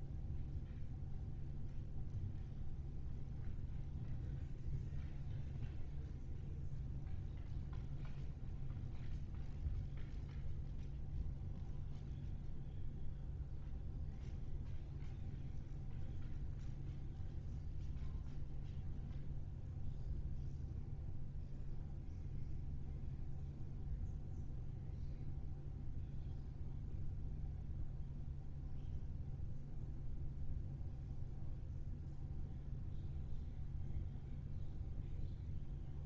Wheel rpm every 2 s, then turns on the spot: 0, 0, 0, 0, 0, 0, 0, 0, 0, 0, 0, 0, 0, 0, 0, 0, 0, 0.
none